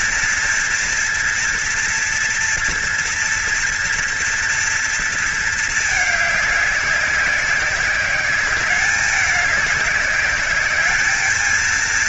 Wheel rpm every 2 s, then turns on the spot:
230, 230, 230, 200, 200, 200.
none